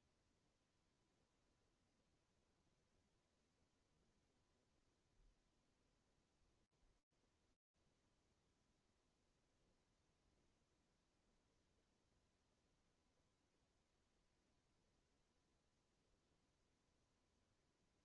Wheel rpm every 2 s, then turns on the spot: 0, 0, 0, 0, 0, 0, 0, 0, 0.
none